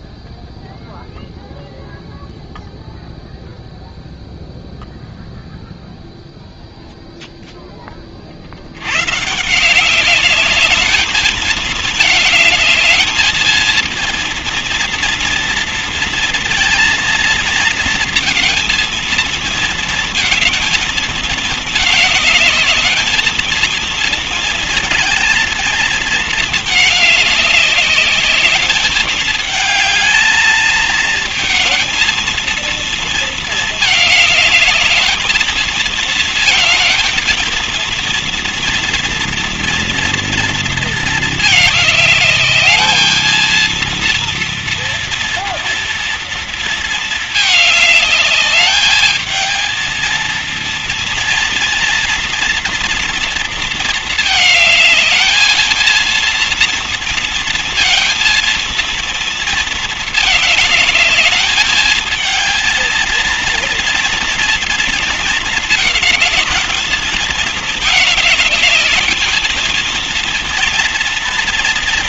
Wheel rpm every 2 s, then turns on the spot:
0, 0, 0, 0, 80, 210, 210, 230, 230, 230, 220, 210, 220, 210, 210, 220, 230, 210, 220, 230, 230, 210, 230, 230, 210, 230, 230, 220, 230, 230, 210, 230, 230, 230, 220, 230.
none